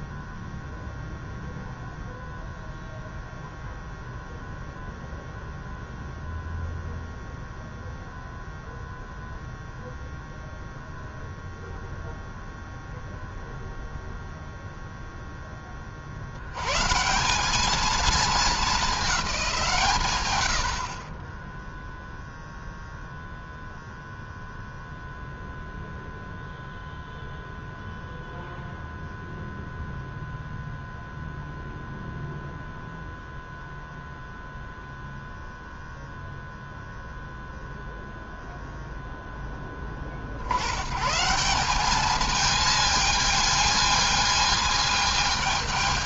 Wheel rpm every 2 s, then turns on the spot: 0, 0, 0, 0, 0, 0, 0, 0, 120, 210, 50, 0, 0, 0, 0, 0, 0, 0, 0, 0, 120, 220, 220.
none